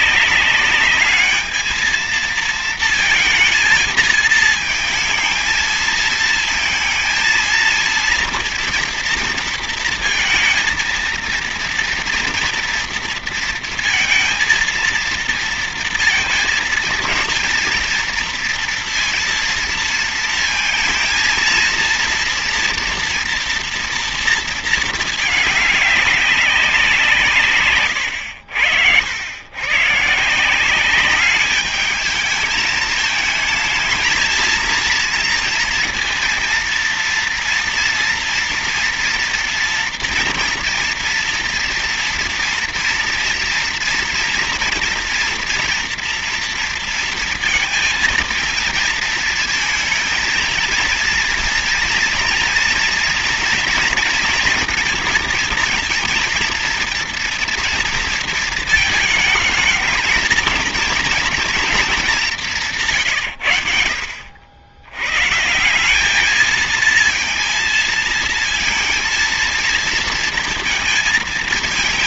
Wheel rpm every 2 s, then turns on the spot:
210, 230, 230, 220, 230, 220, 230, 230, 230, 230, 220, 230, 230, 180, 90, 180, 210, 230, 230, 230, 240, 230, 230, 230, 220, 220, 230, 230, 230, 220, 220, 170, 90, 220, 230, 230.
none